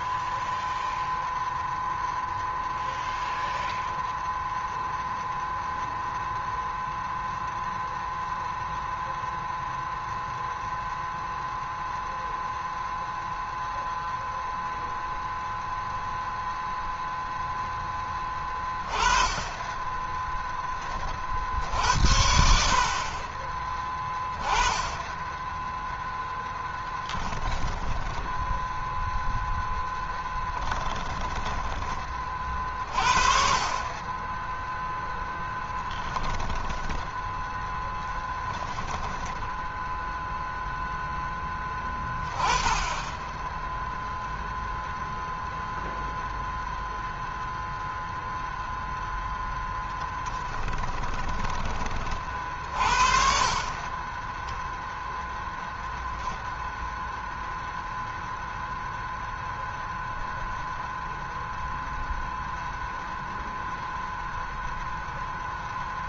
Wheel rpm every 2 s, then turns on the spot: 0, 0, 0, 0, 0, 0, 0, 0, 0, 20, 30, 50, 20, 10, 0, 10, 40, 0, 10, 0, 0, 20, 0, 0, 0, 20, 50, 0, 0, 0, 0, 0, 0.
26-28 30-32 36-38 50-52